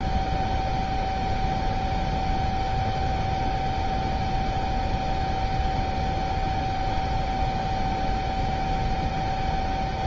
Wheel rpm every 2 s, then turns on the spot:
0, 0, 0, 0, 0.
none